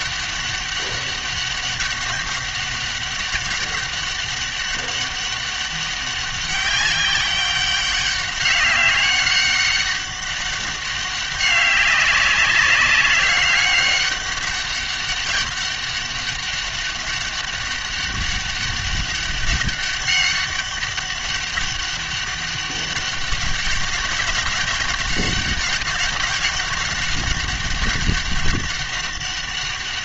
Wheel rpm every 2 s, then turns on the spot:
200, 200, 200, 200, 190, 200, 200, 200, 200, 200, 200, 200, 190, 200, 200.
none